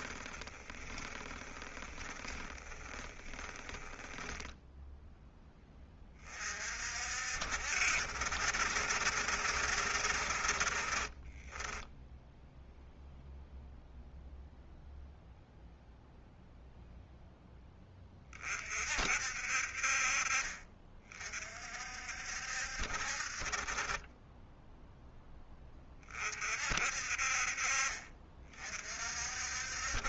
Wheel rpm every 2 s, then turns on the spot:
20, 20, 0, 50, 70, 50, 0, 0, 0, 50, 40, 60, 10, 50, 40.
0-4